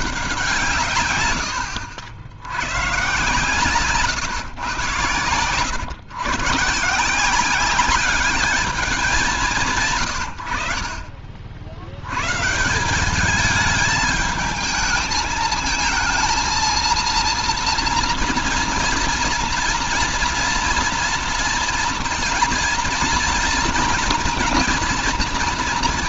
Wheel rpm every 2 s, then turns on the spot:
160, 110, 110, 140, 210, 60, 170, 220, 230, 230, 230, 230, 240.
none